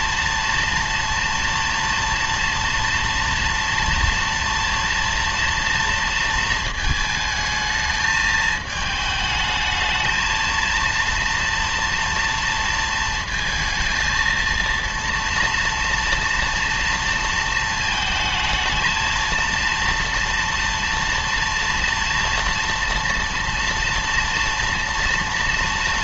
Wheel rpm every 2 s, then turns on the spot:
230, 230, 230, 220, 220, 230, 230, 230, 230, 220, 230, 230, 230.
none